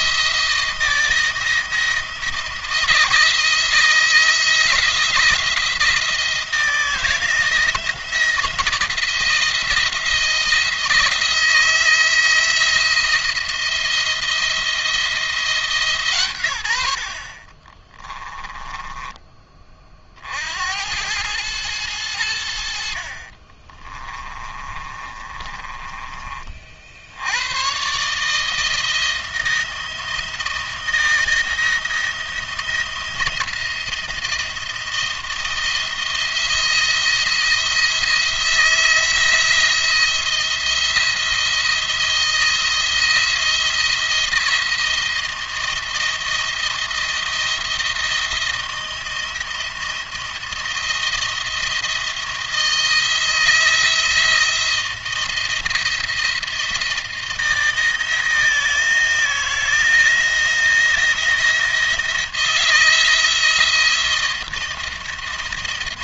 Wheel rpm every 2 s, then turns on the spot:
170, 170, 170, 160, 170, 170, 170, 170, 100, 10, 70, 70, 30, 40, 160, 170, 170, 170, 170, 170, 170, 170, 170, 170, 160, 170, 170, 170, 170, 160, 170, 160, 170.
18-20 24-26